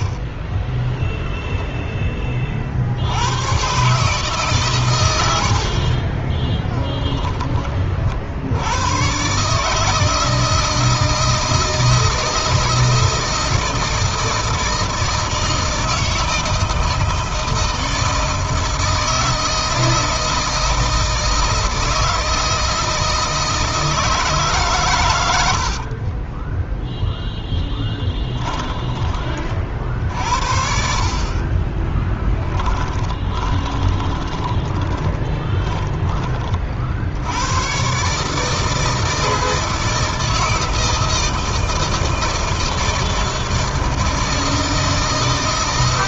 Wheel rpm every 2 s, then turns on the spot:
10, 60, 120, 10, 100, 160, 160, 160, 160, 160, 160, 160, 120, 10, 20, 60, 10, 20, 60, 160, 160, 160, 160.
26-30 32-36